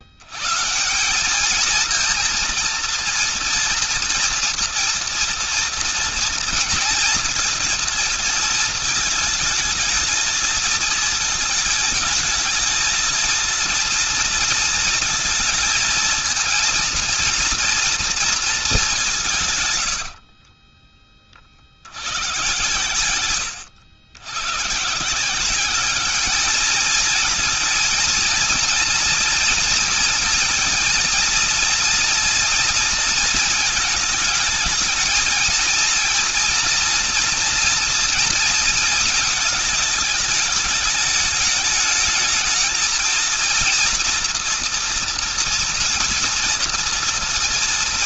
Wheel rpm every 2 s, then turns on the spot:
150, 230, 240, 230, 220, 220, 220, 230, 230, 200, 30, 110, 150, 220, 230, 230, 230, 220, 230, 230, 210, 220, 230, 230.
20-22